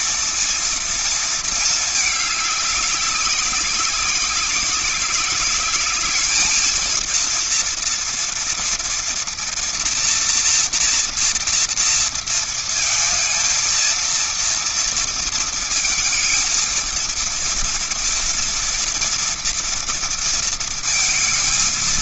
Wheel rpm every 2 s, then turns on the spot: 230, 210, 190, 210, 230, 240, 230, 230, 230, 230, 230.
none